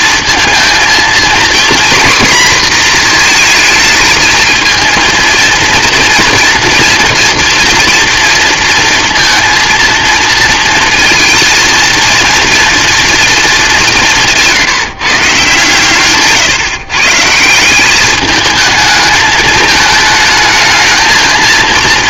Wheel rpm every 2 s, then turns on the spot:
230, 240, 220, 230, 230, 220, 230, 170, 140, 220, 220.
none